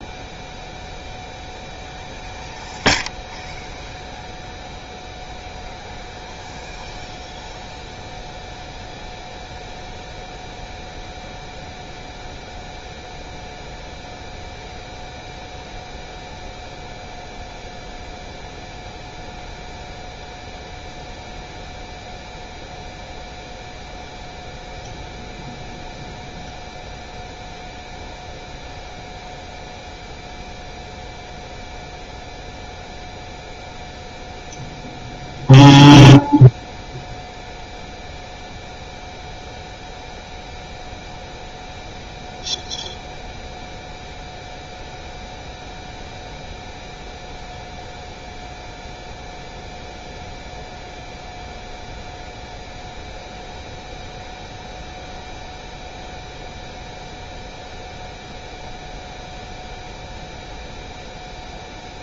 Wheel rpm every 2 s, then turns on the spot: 0, 0, 0, 0, 0, 0, 0, 0, 0, 0, 0, 0, 0, 0, 0, 0, 0, 0, 0, 0, 0, 0, 0, 0, 0, 0, 0, 0, 0, 0, 0.
none